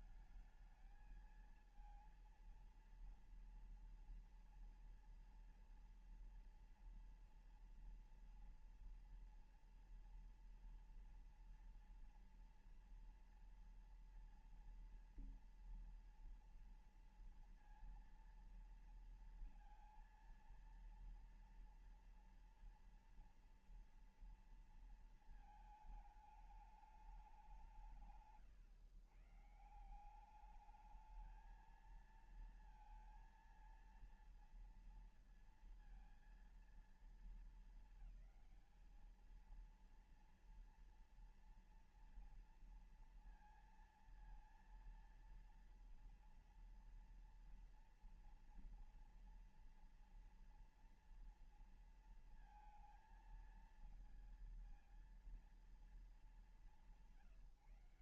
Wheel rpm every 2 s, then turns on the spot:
220, 230, 230, 230, 230, 230, 230, 230, 230, 230, 230, 230, 230, 210, 150, 200, 230, 230, 230, 220, 230, 230, 230, 230, 230, 230, 230, 230, 180.
none